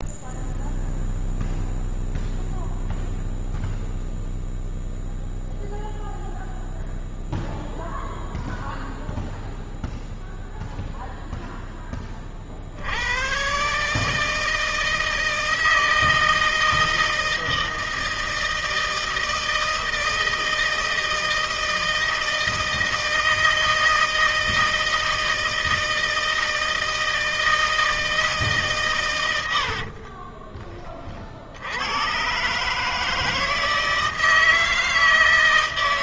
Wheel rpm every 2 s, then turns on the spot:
0, 0, 0, 0, 0, 0, 40, 160, 160, 160, 160, 160, 160, 160, 150, 30, 120, 160.
30-32